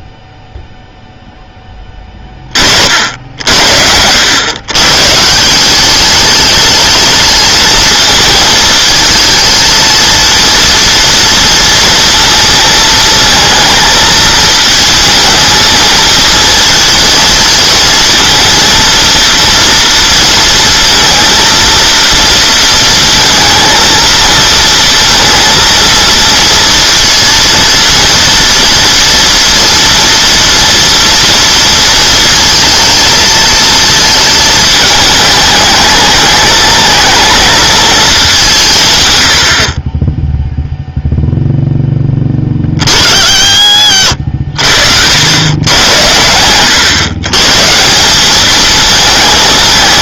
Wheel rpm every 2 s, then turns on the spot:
0, 50, 130, 210, 220, 230, 220, 220, 230, 230, 230, 230, 230, 230, 240, 230, 230, 220, 210, 150, 0, 40, 70, 110, 220.
44-46